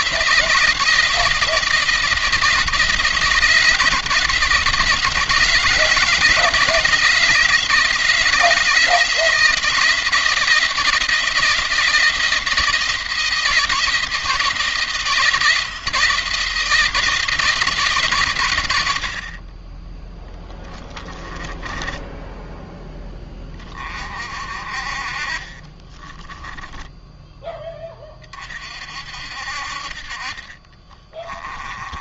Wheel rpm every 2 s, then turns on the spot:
170, 160, 160, 160, 160, 170, 170, 170, 170, 80, 20, 10, 40, 10, 50, 30.
30-32